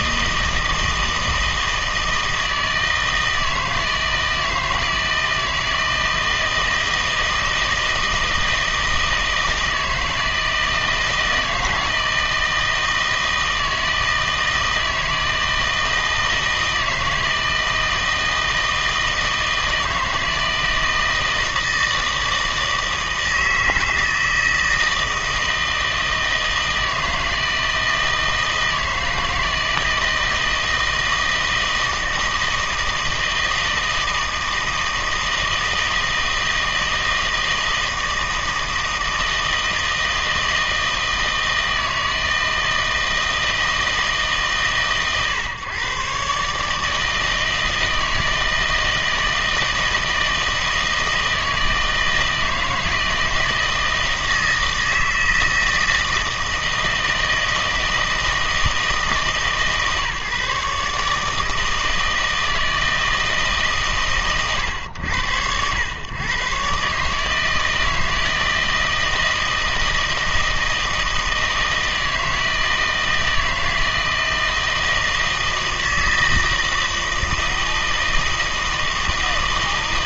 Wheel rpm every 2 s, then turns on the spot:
160, 160, 160, 160, 160, 160, 160, 160, 160, 160, 160, 160, 160, 160, 160, 160, 160, 160, 160, 160, 160, 160, 140, 150, 160, 160, 160, 160, 160, 160, 140, 160, 120, 130, 160, 160, 160, 160, 160, 160.
none